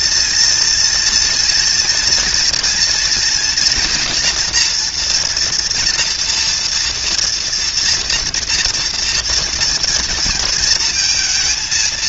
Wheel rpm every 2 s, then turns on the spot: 230, 230, 230, 230, 240, 230.
none